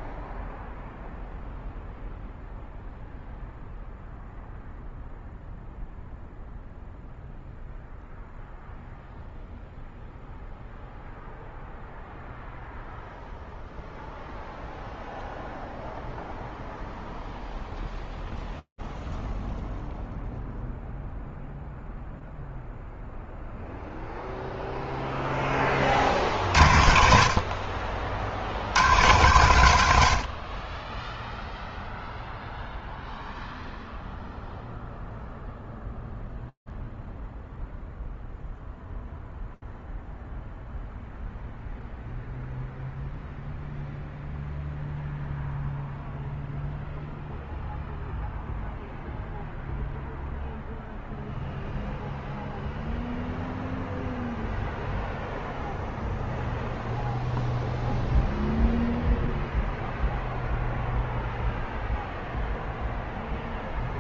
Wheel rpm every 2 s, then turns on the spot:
0, 0, 0, 0, 0, 0, 0, 0, 0, 0, 0, 0, 0, 30, 60, 110, 0, 0, 0, 0, 0, 0, 0, 0, 0, 0, 0, 0, 0, 0, 0, 0.
none